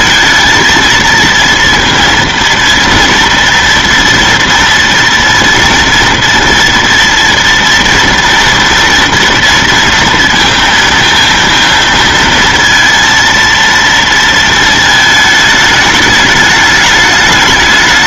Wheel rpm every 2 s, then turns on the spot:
220, 230, 230, 230, 230, 230, 230, 230, 210.
none